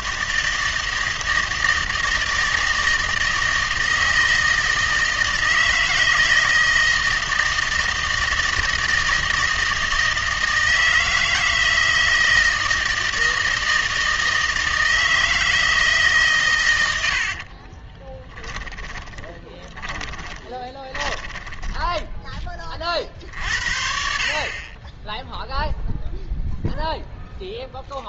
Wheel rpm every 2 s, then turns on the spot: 160, 160, 160, 160, 160, 160, 160, 160, 100, 10, 20, 40, 20, 0.
18-22